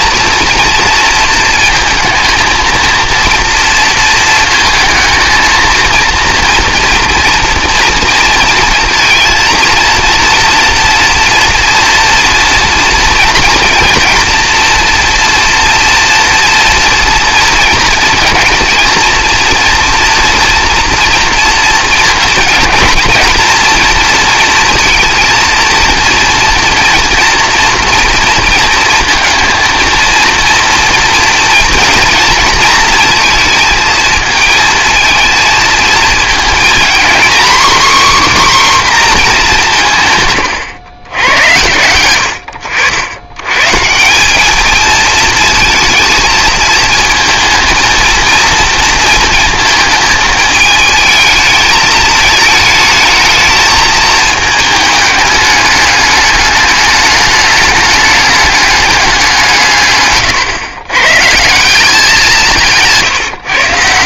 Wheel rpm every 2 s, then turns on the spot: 230, 220, 220, 230, 230, 230, 240, 230, 230, 230, 230, 230, 230, 230, 230, 230, 230, 230, 230, 270, 110, 80, 210, 230, 230, 220, 220, 220, 210, 210, 120, 160.
40-42